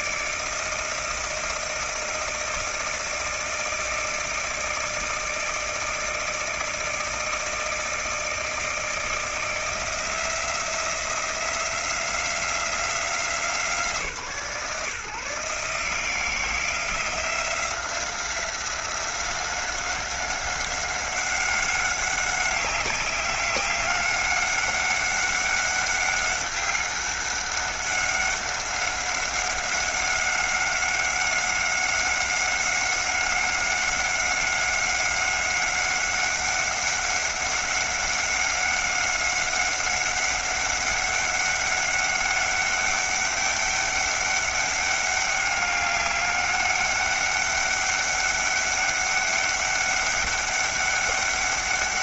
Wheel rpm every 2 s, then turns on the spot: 160, 160, 160, 160, 160, 170, 170, 140, 170, 180, 200, 190, 190, 190, 190, 190, 190, 190, 190, 190, 200, 200, 200, 200, 200, 200.
none